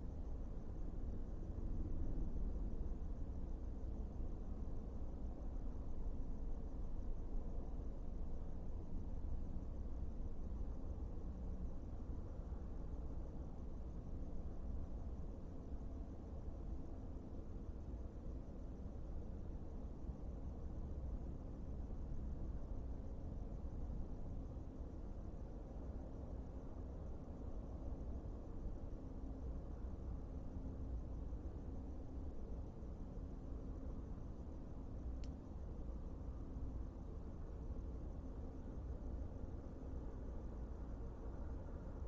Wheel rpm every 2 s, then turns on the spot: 0, 0, 0, 0, 0, 0, 0, 0, 0, 0, 0, 0, 0, 0, 0, 0, 0, 0, 0, 0, 0.
none